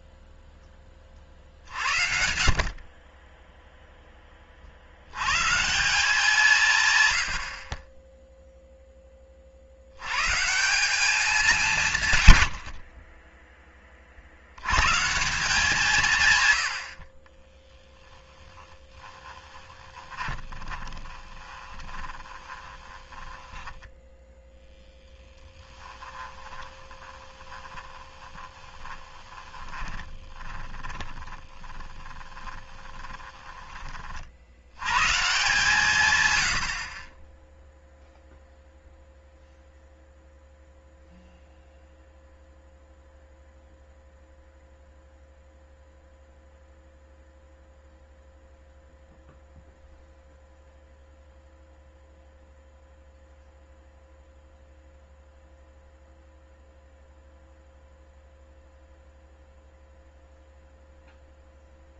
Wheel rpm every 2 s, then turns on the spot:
10, 40, 60, 140, 0, 170, 80, 110, 90, 10, 20, 20, 0, 20, 20, 20, 20, 100, 60, 0, 0, 0, 0, 0, 0, 0, 0, 0, 0, 0, 0.
18-24 26-34